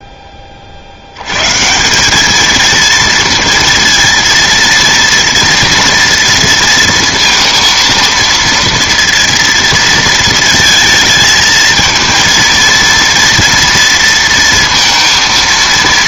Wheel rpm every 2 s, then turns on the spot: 60, 230, 230, 230, 230, 230, 230, 230.
none